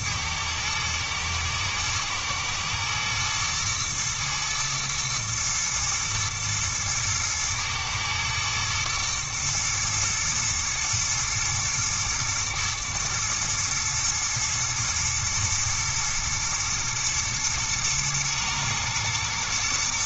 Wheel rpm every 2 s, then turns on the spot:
110, 110, 120, 110, 120, 120, 120, 120, 120, 110.
none